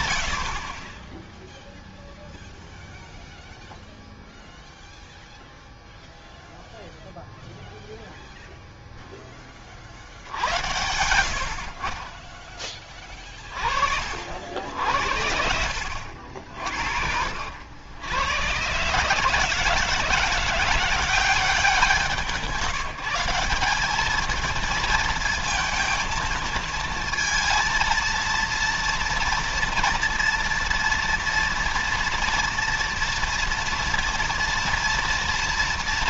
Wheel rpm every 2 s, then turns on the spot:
60, 0, 0, 0, 0, 80, 20, 70, 60, 110, 170, 170, 230, 230, 230, 230, 230, 230.
10-12